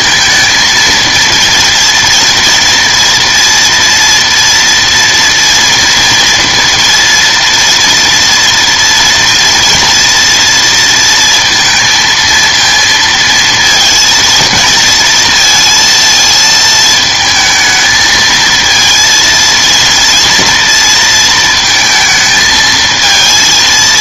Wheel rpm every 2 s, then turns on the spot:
230, 230, 230, 230, 230, 230, 230, 230, 220, 220, 230, 220.
none